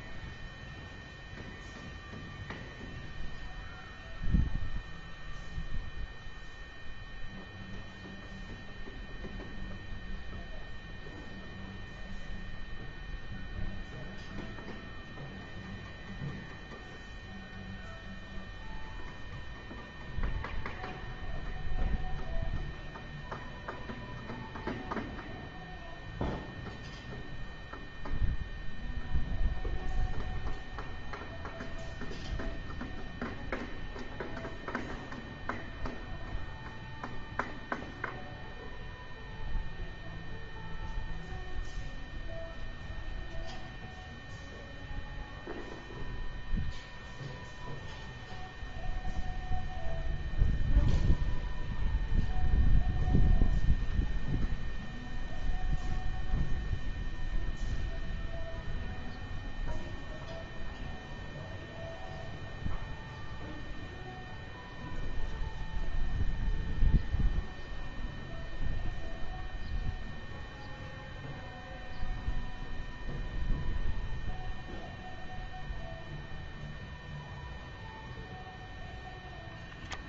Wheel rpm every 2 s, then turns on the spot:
0, 0, 0, 0, 0, 0, 0, 0, 0, 0, 0, 0, 0, 0, 0, 0, 0, 0, 0, 0, 0, 0, 0, 0, 0, 0, 0, 0, 0, 0, 0, 0, 0, 0, 0, 0, 0, 0, 0, 0.
none